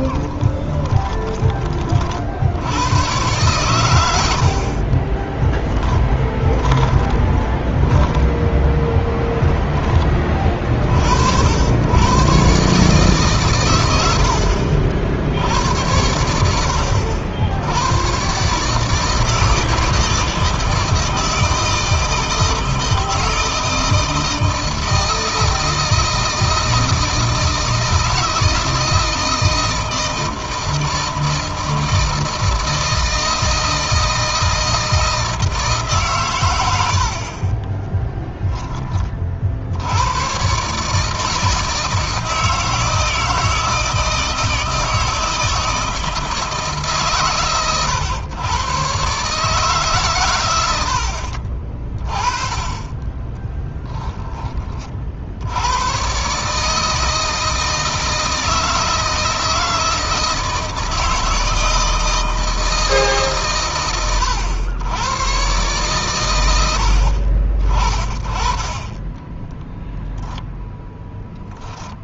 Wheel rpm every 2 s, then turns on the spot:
10, 100, 40, 20, 10, 50, 140, 60, 80, 150, 160, 160, 160, 160, 160, 160, 160, 160, 100, 20, 140, 160, 160, 140, 130, 100, 20, 40, 160, 160, 160, 160, 110, 70, 20, 0.
0-2 4-10 50-52 68-70